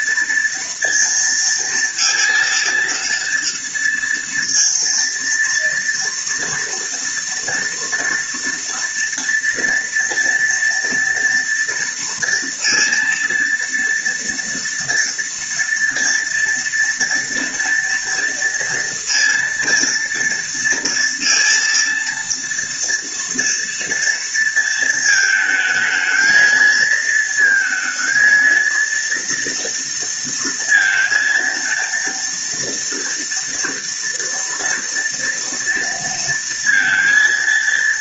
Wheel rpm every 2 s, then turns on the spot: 230, 230, 230, 230, 230, 230, 230, 230, 230, 230, 230, 230, 230, 220, 230, 230, 230, 230, 230.
none